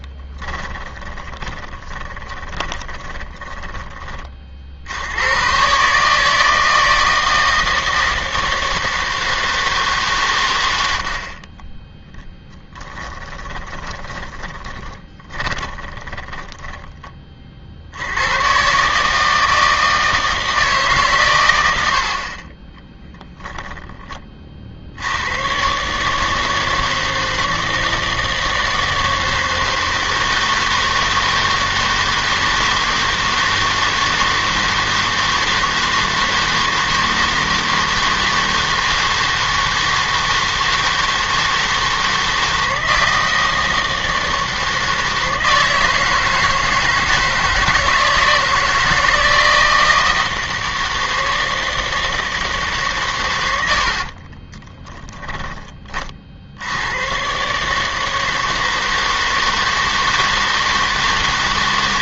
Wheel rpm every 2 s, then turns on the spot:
10, 20, 50, 160, 160, 100, 20, 20, 10, 130, 150, 20, 40, 160, 160, 160, 160, 160, 160, 160, 160, 160, 160, 160, 160, 160, 150, 20, 80, 160, 160.
0-4 12-18 22-24 54-56